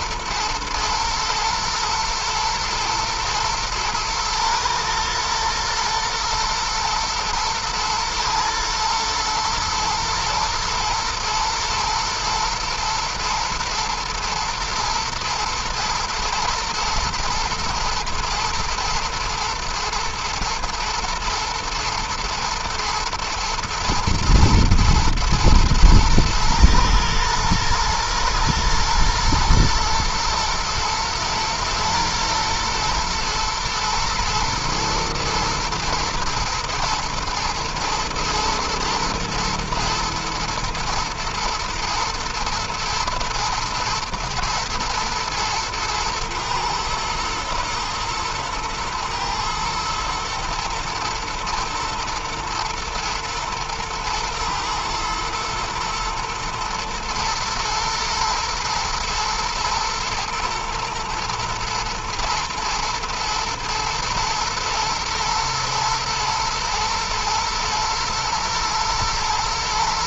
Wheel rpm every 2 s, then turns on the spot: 110, 120, 120, 110, 110, 110, 110, 110, 120, 110, 110, 110, 110, 110, 120, 110, 120, 110, 120, 120, 120, 110, 120, 120, 110, 110, 110, 110, 110, 110, 110, 110, 120, 110, 120.
none